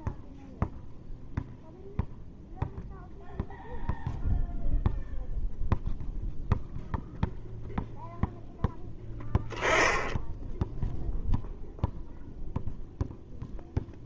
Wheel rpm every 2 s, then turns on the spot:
0, 0, 0, 0, 10, 0, 0.
none